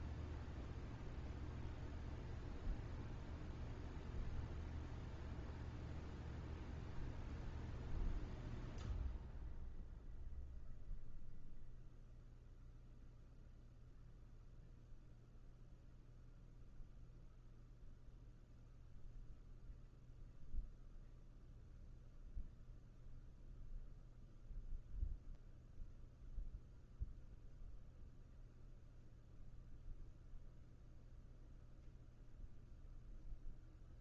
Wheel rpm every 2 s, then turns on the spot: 0, 0, 0, 0, 0, 0, 0, 0, 0, 0, 0, 0, 0, 0, 0, 0, 0.
none